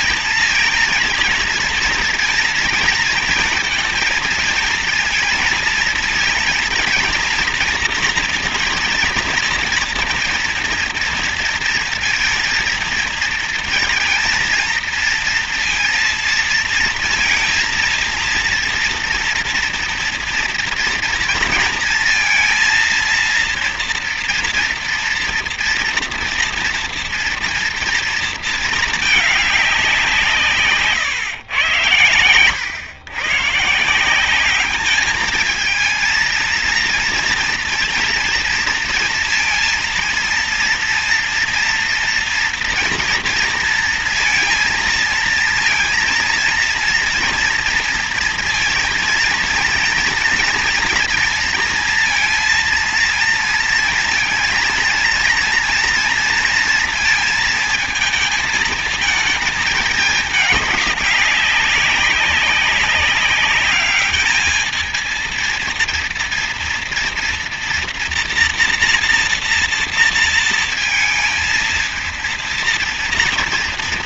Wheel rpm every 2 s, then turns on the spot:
230, 230, 230, 230, 230, 230, 230, 230, 230, 230, 230, 230, 230, 230, 220, 150, 120, 210, 230, 230, 230, 230, 230, 230, 230, 230, 230, 230, 230, 220, 200, 190, 220, 230, 240, 230, 230.
none